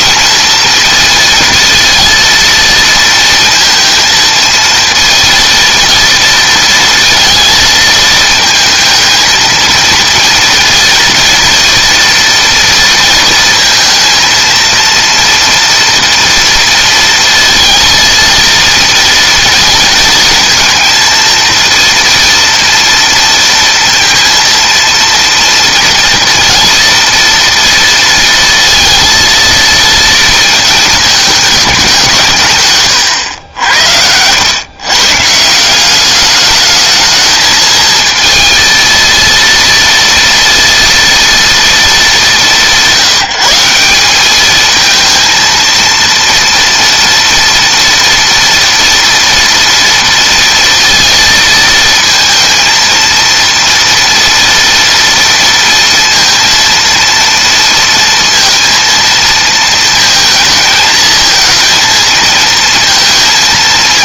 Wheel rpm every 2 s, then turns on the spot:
230, 230, 230, 230, 220, 230, 240, 220, 230, 230, 230, 230, 230, 230, 230, 230, 170, 90, 200, 220, 230, 200, 200, 230, 230, 230, 230, 230, 230, 230, 220, 230.
none